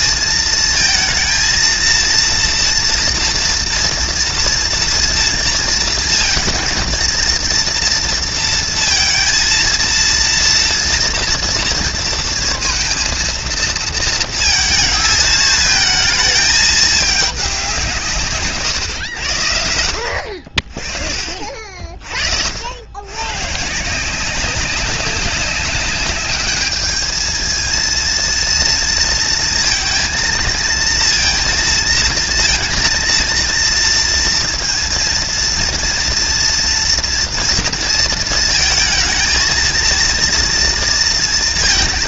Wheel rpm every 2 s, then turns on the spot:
230, 230, 230, 230, 230, 230, 230, 230, 210, 120, 40, 90, 190, 210, 230, 230, 230, 230, 240, 230, 230.
none